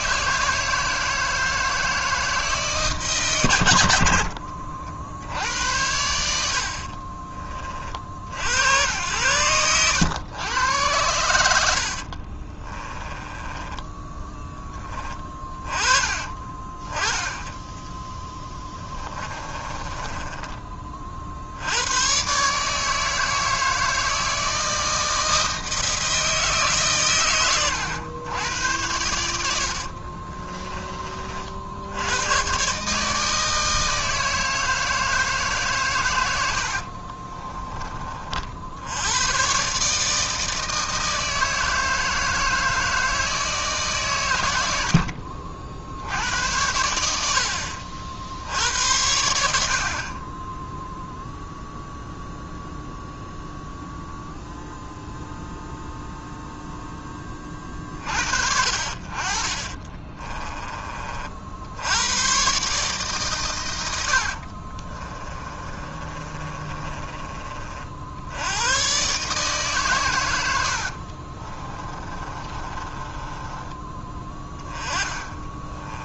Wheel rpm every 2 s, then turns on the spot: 160, 150, 50, 60, 90, 100, 20, 10, 30, 20, 30, 150, 160, 150, 100, 30, 140, 160, 60, 70, 160, 160, 80, 90, 80, 0, 0, 0, 10, 50, 30, 140, 30, 30, 110, 70, 30, 20.
6-8 12-14 18-20 36-38 64-68 70-76